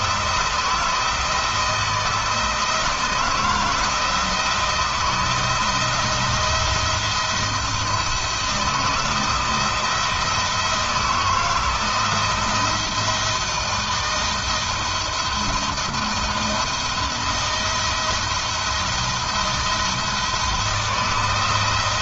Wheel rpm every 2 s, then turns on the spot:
160, 160, 160, 170, 170, 170, 160, 170, 170, 170, 170.
none